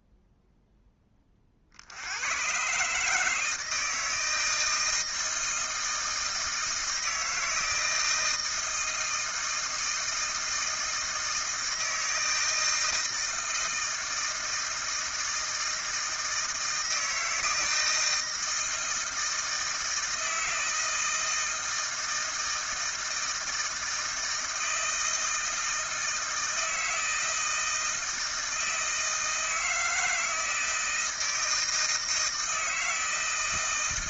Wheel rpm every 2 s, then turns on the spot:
10, 140, 160, 160, 160, 160, 160, 160, 160, 160, 160, 160, 160, 160, 160, 160, 160.
none